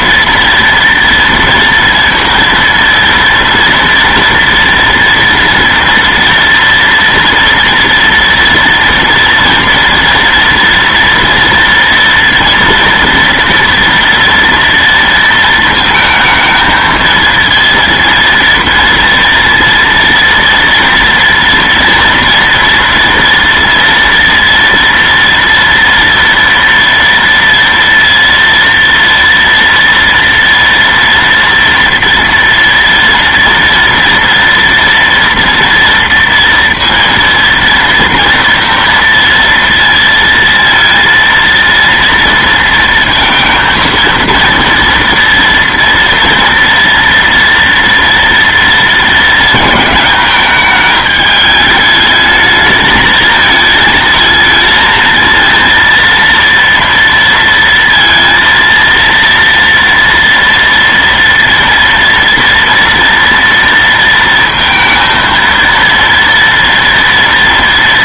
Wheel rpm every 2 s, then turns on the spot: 230, 230, 230, 230, 230, 230, 230, 230, 220, 230, 230, 230, 230, 230, 230, 230, 230, 230, 230, 230, 230, 230, 230, 240, 230, 210, 220, 220, 230, 230, 230, 230, 230, 230.
none